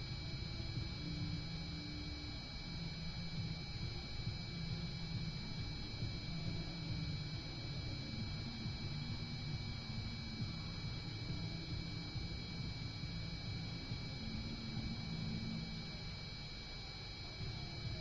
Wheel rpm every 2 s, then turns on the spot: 0, 0, 0, 0, 0, 0, 0, 0, 0.
none